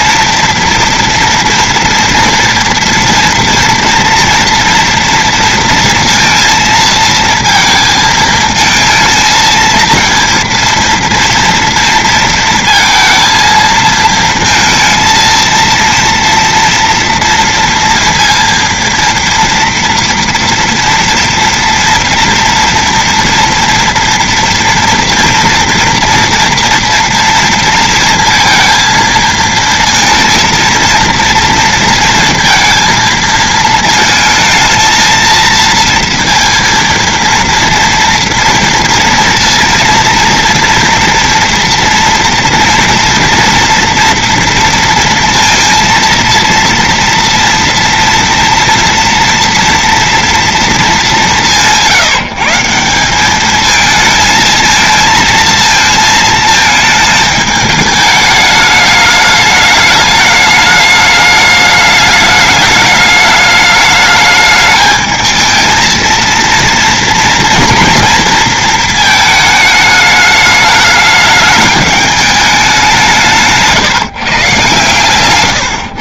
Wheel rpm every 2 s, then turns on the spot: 230, 240, 240, 230, 220, 230, 230, 230, 230, 230, 230, 230, 230, 240, 230, 230, 230, 220, 230, 230, 230, 230, 230, 230, 240, 240, 170, 220, 220, 210, 210, 210, 210, 230, 230, 210, 210, 140.
none